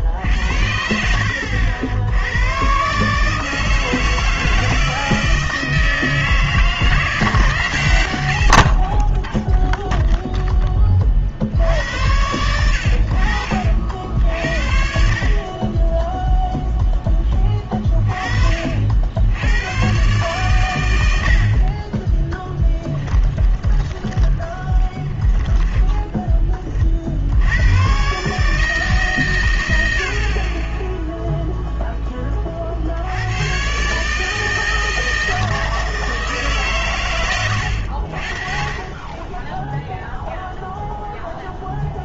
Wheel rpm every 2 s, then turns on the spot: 60, 120, 160, 160, 50, 10, 80, 50, 0, 50, 120, 20, 20, 30, 150, 30, 40, 160, 140, 40, 0.
22-26